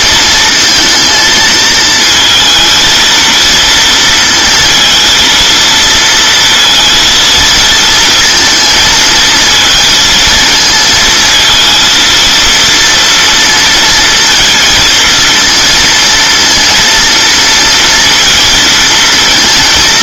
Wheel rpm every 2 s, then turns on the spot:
230, 220, 230, 230, 220, 220, 230, 230, 230, 230.
none